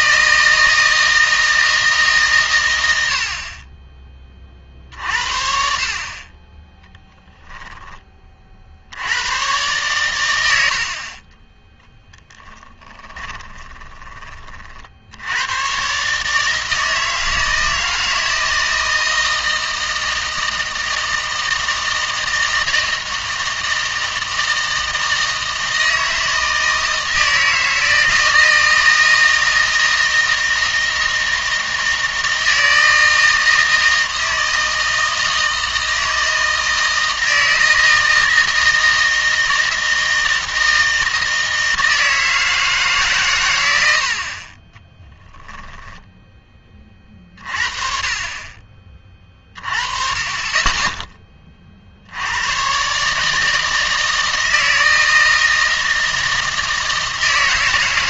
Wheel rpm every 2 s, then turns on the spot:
160, 100, 50, 10, 70, 70, 10, 40, 160, 160, 160, 160, 160, 160, 160, 160, 160, 160, 160, 160, 160, 150, 20, 20, 30, 20, 130, 160, 160.
12-14 44-46